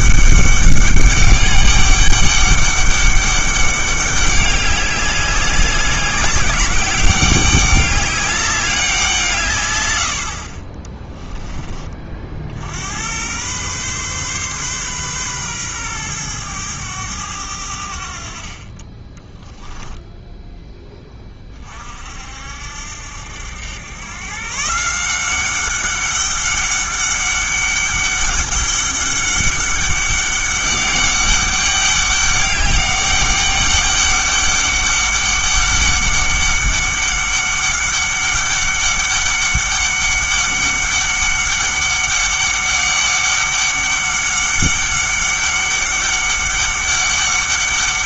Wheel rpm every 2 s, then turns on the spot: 200, 200, 200, 190, 190, 40, 70, 130, 110, 30, 20, 70, 150, 200, 200, 200, 200, 200, 200, 200, 200, 200, 200, 200.
none